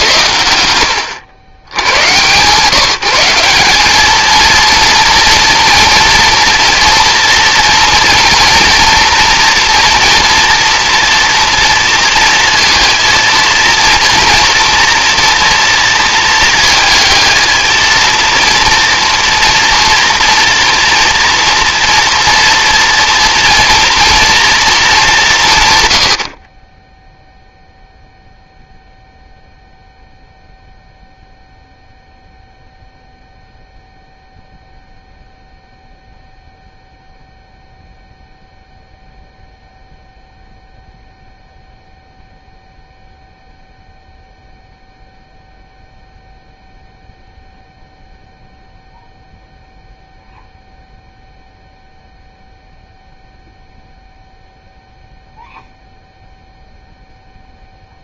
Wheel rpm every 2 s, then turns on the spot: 70, 160, 220, 230, 230, 230, 230, 240, 230, 230, 230, 230, 230, 50, 0, 0, 0, 0, 0, 0, 0, 0, 0, 0, 0, 0, 0, 0, 0.
none